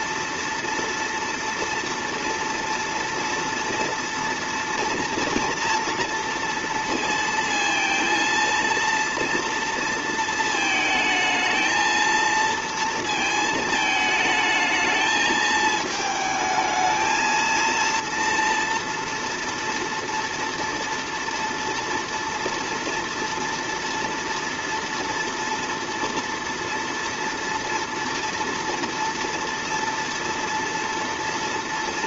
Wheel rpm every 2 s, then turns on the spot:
230, 230, 230, 230, 230, 220, 230, 220, 220, 230, 230, 230, 230, 230, 230, 230.
none